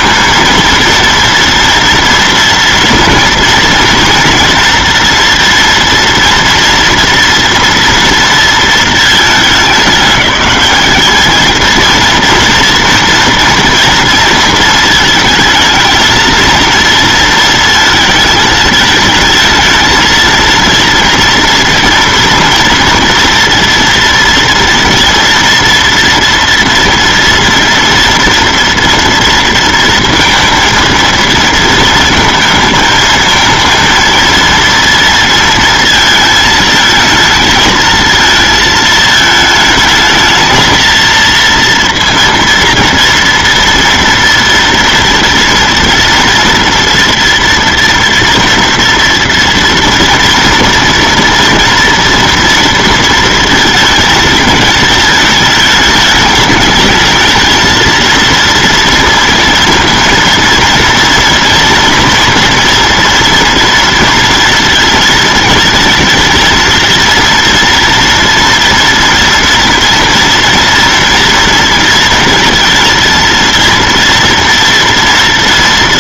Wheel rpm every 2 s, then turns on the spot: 220, 230, 230, 230, 230, 210, 240, 230, 230, 220, 230, 230, 230, 230, 230, 230, 220, 230, 220, 220, 220, 230, 230, 230, 230, 230, 230, 220, 210, 230, 230, 230, 230, 230, 230, 230, 230, 230.
none